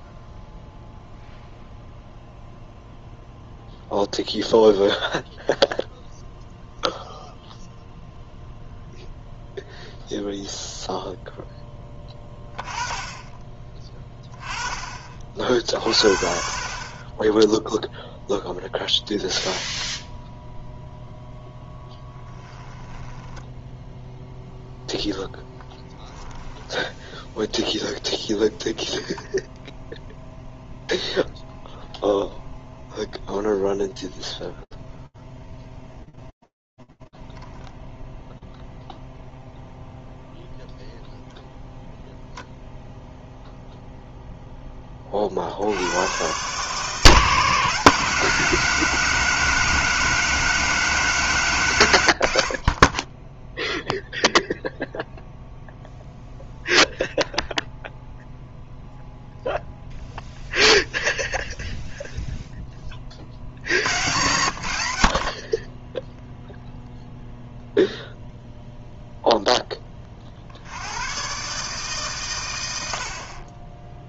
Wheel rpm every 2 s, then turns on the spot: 0, 0, 0, 0, 0, 10, 10, 50, 0, 0, 0, 0, 10, 0, 0, 0, 0, 0, 0, 0, 0, 10, 140, 190, 190, 60, 0, 0, 0, 0, 10, 80, 0, 0, 70, 90, 0.
none